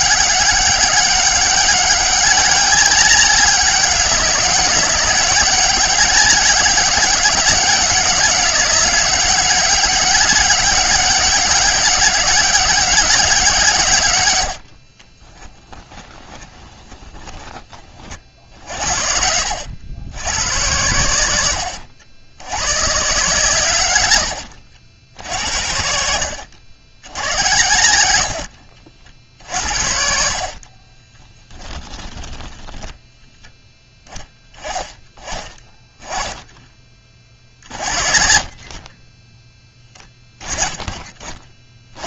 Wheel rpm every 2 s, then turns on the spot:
190, 200, 200, 200, 190, 200, 200, 50, 20, 70, 100, 120, 90, 90, 60, 40, 10, 20, 20, 30, 20.
14-18 28-34